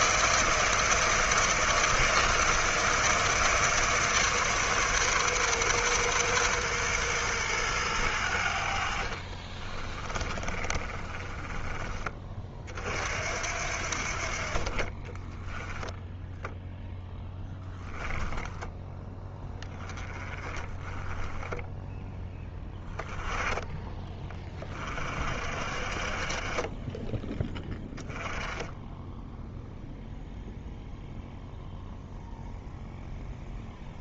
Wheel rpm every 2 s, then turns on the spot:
160, 160, 140, 120, 60, 30, 50, 30, 0, 10, 20, 10, 40, 20, 10, 0, 0.
10-12 14-16